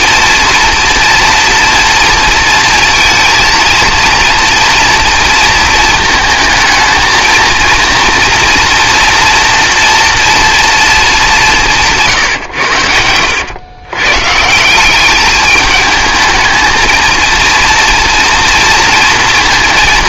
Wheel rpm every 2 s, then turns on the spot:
230, 230, 230, 220, 240, 230, 100, 170, 220, 230.
none